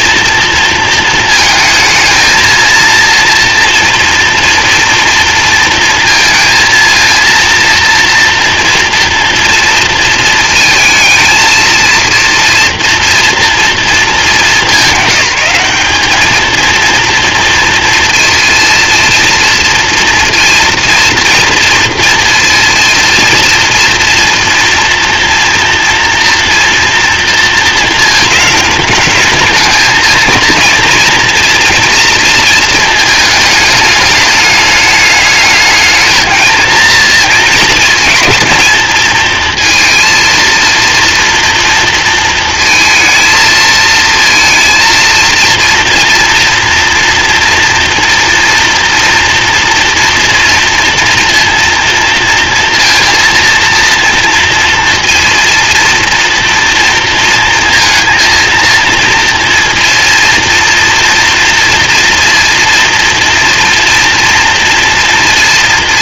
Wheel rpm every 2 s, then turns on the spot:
230, 230, 230, 230, 230, 230, 230, 190, 220, 230, 230, 230, 240, 230, 220, 230, 220, 210, 230, 220, 230, 230, 230, 230, 230, 230, 230, 230, 230, 230, 230, 240, 230.
none